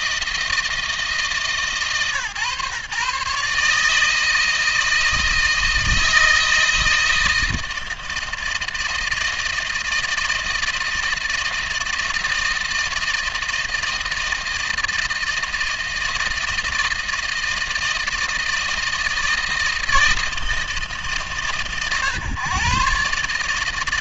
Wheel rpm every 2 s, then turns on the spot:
160, 130, 160, 160, 160, 160, 160, 160, 160, 160, 160, 130.
none